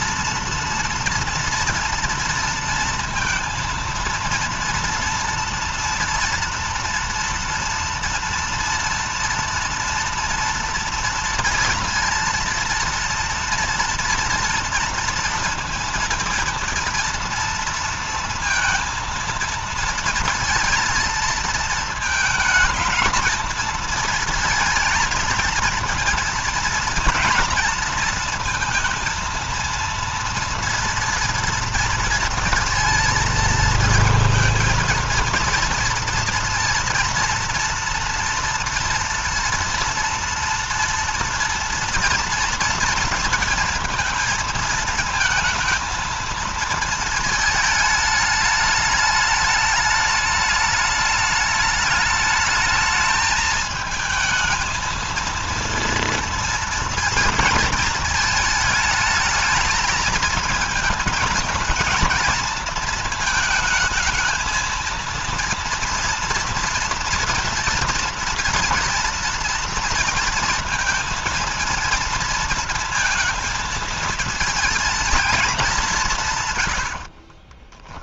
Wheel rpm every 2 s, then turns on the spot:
230, 230, 230, 230, 230, 230, 230, 240, 230, 230, 230, 220, 230, 230, 230, 230, 230, 230, 230, 230, 230, 230, 230, 220, 210, 210, 210, 220, 230, 220, 220, 230, 220, 230, 230, 230, 230, 230, 110.
76-78